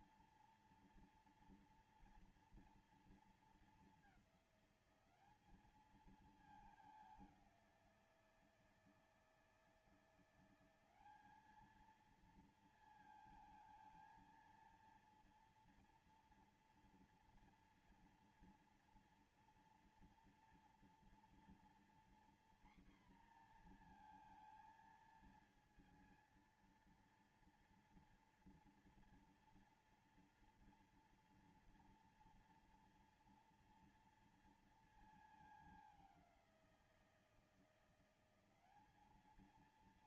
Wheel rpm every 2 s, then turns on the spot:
230, 230, 200, 210, 160, 190, 230, 230, 240, 230, 230, 240, 230, 230, 230, 230, 230, 220, 180, 200.
none